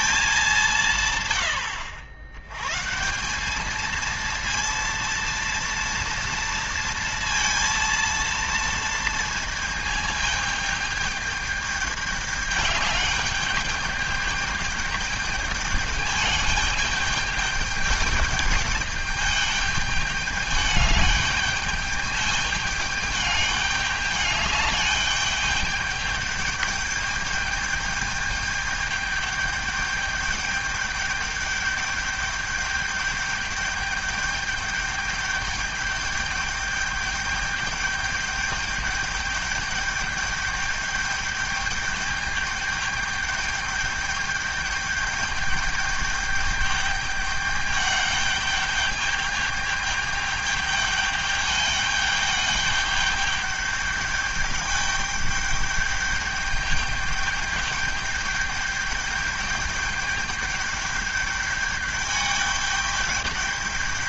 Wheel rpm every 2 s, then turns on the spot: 180, 110, 230, 230, 230, 210, 210, 210, 210, 210, 210, 210, 210, 210, 210, 200, 210, 210, 210, 210, 210, 210, 210, 210, 210, 210, 210, 210, 210, 210, 210, 210.
none